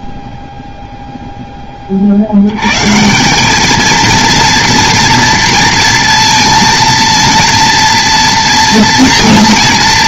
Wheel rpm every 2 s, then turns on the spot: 10, 200, 230, 230, 230.
none